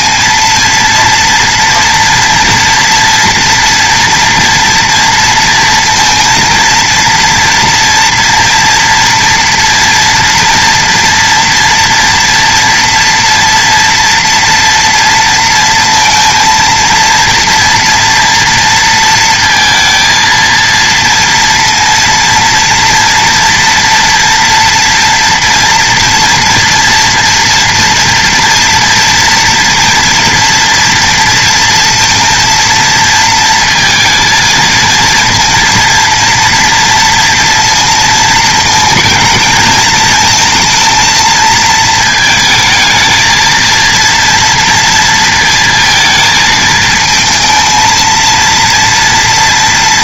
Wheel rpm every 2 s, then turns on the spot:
230, 240, 230, 230, 230, 230, 230, 230, 230, 230, 230, 230, 230, 240, 230, 230, 230, 230, 240, 230, 230, 220, 230, 220, 230.
none